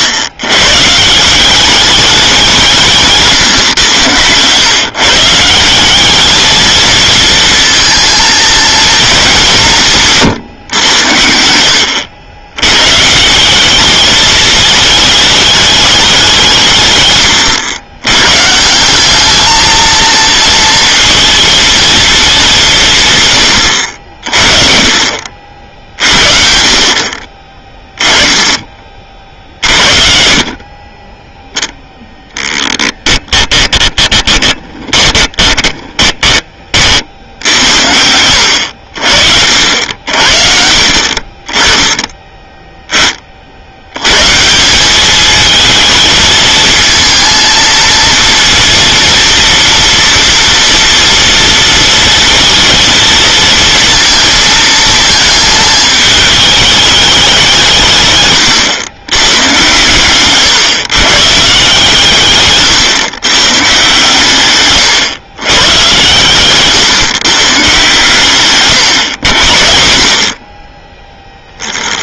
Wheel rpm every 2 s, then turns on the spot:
130, 180, 130, 220, 230, 120, 110, 220, 160, 160, 230, 180, 40, 50, 20, 40, 10, 20, 30, 80, 50, 10, 160, 220, 230, 230, 220, 220, 210, 130, 130, 140, 140, 140, 130, 40.
34-36 62-64